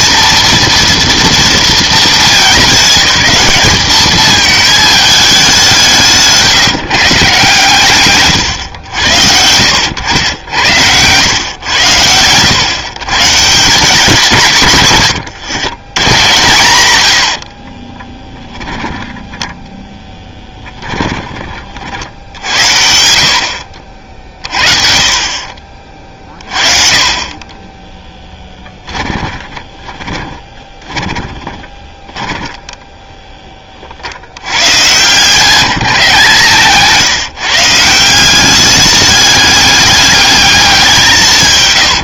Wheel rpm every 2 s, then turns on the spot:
230, 210, 210, 150, 120, 100, 110, 140, 130, 10, 10, 70, 50, 40, 10, 20, 10, 100, 150, 190, 200.
10-12 16-22 24-26 28-32 36-38